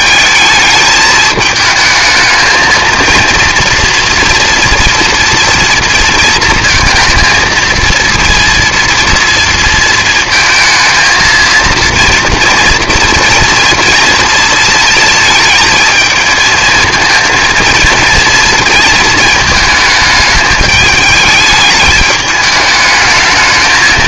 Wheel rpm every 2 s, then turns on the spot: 210, 220, 230, 230, 230, 230, 230, 230, 220, 220, 210, 210.
none